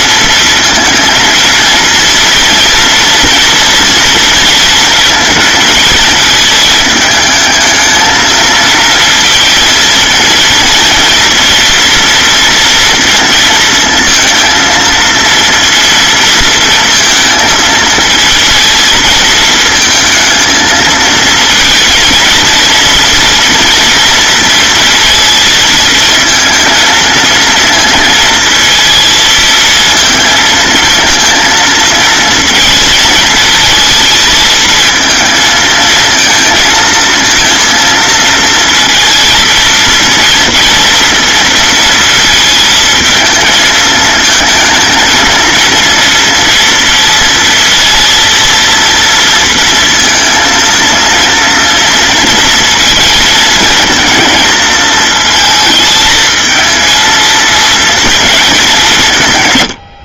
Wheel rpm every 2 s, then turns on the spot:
230, 230, 230, 220, 230, 230, 230, 230, 220, 220, 230, 230, 230, 220, 230, 230, 230, 220, 220, 230, 230, 220, 220, 230, 230, 230, 230, 220, 230, 160.
none